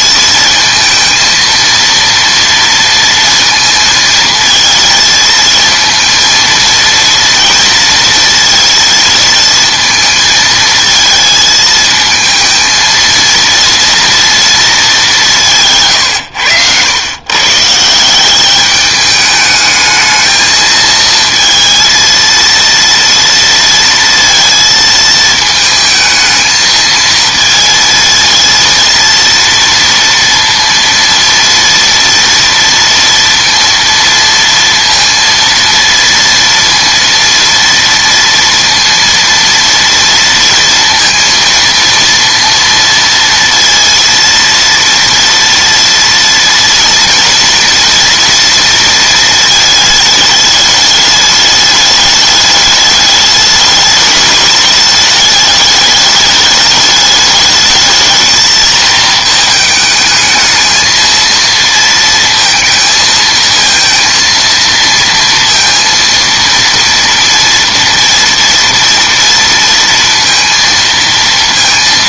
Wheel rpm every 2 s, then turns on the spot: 230, 230, 230, 230, 230, 220, 230, 220, 90, 210, 220, 230, 230, 220, 230, 230, 230, 230, 230, 230, 230, 230, 230, 230, 230, 210, 210, 210, 210, 220, 220, 230, 230, 230, 230, 230.
none